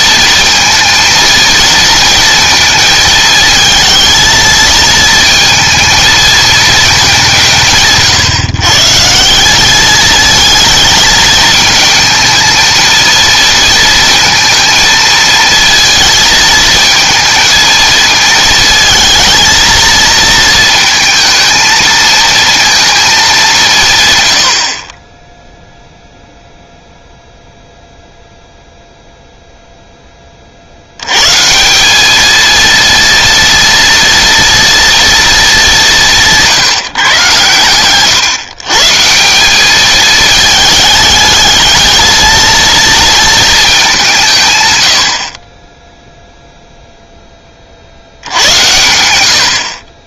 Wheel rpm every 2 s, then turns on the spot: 230, 220, 230, 220, 140, 220, 230, 230, 220, 220, 220, 230, 70, 0, 0, 50, 230, 230, 160, 140, 210, 230, 140, 0, 80.
none